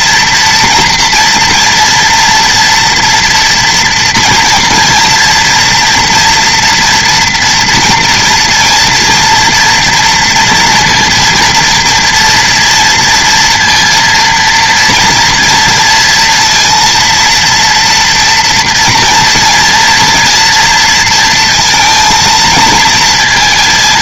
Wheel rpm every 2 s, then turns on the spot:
230, 230, 230, 230, 230, 230, 230, 230, 230, 230, 230, 220.
none